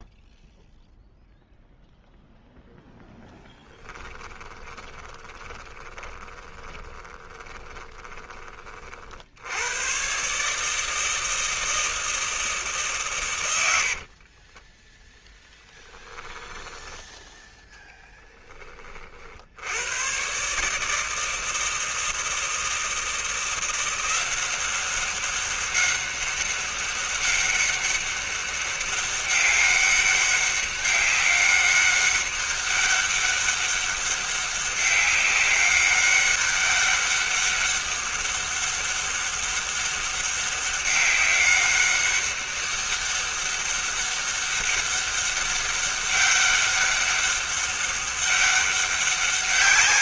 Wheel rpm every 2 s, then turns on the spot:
0, 0, 20, 20, 30, 150, 160, 30, 10, 30, 140, 160, 190, 200, 200, 200, 200, 190, 200, 200, 200, 200, 200, 200, 200.
4-8 14-18